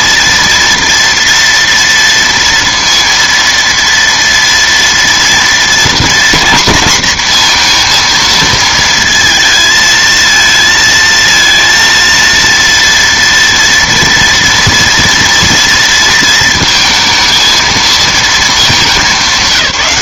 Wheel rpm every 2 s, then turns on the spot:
230, 230, 230, 240, 230, 230, 230, 230, 220, 220.
none